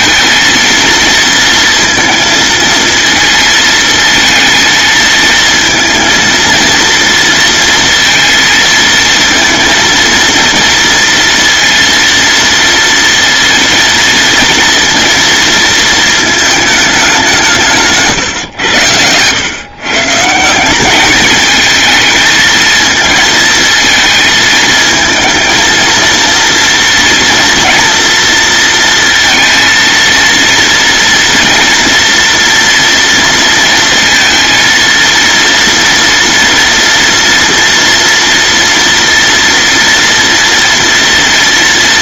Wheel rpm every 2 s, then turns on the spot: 230, 220, 220, 230, 230, 230, 230, 230, 200, 110, 200, 220, 230, 230, 230, 230, 230, 230, 230, 230, 230.
none